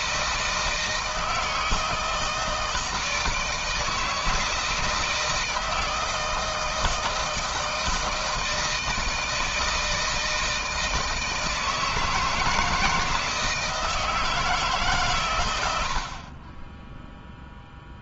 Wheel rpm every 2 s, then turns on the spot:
160, 160, 160, 160, 160, 160, 160, 160, 30.
none